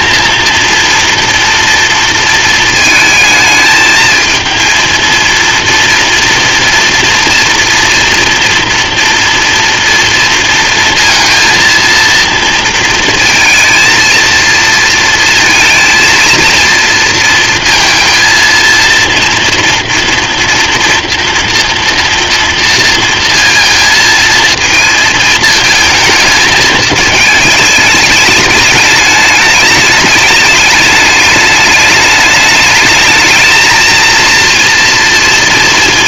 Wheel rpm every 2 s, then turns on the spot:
230, 230, 220, 230, 230, 230, 230, 230, 230, 230, 230, 230, 230, 220, 210, 210, 210, 230.
none